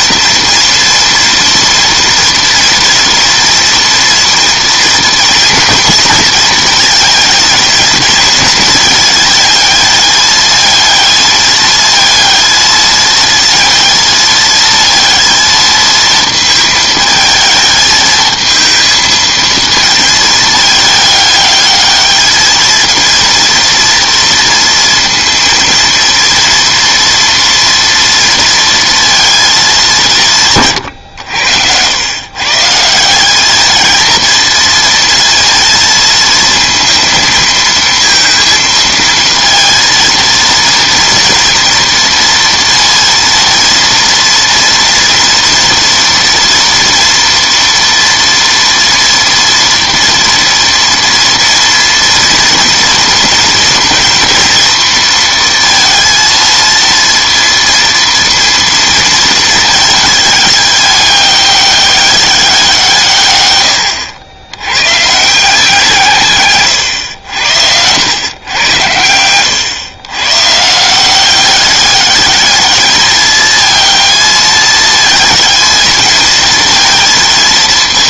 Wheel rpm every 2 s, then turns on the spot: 240, 230, 230, 220, 220, 220, 220, 220, 220, 220, 220, 220, 230, 230, 230, 140, 150, 220, 230, 230, 230, 230, 230, 230, 230, 230, 230, 230, 230, 230, 210, 190, 100, 130, 110, 140, 210, 220, 220.
none